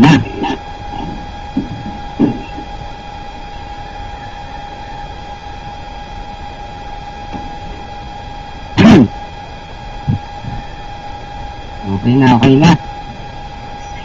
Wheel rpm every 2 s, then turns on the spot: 0, 0, 0, 0, 0, 0, 0.
none